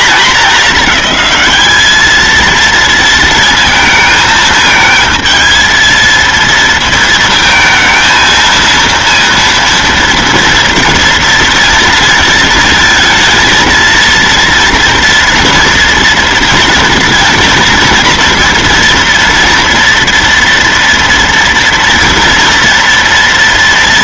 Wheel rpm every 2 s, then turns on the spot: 220, 230, 220, 230, 230, 230, 230, 230, 240, 230, 230, 230.
none